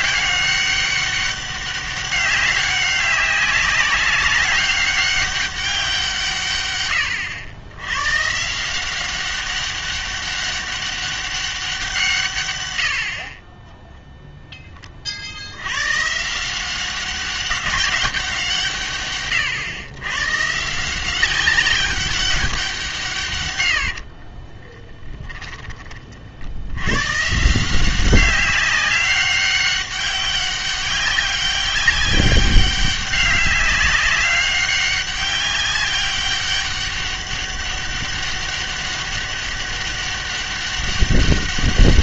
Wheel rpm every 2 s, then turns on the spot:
200, 200, 200, 110, 170, 200, 80, 20, 190, 150, 160, 180, 20, 90, 190, 200, 200, 200, 200, 200, 200.
24-26